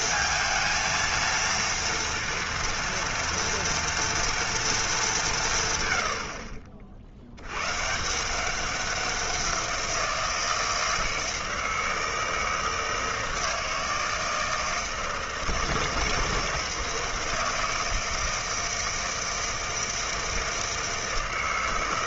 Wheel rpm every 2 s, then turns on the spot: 230, 230, 220, 60, 190, 160, 160, 160, 160, 160, 160.
none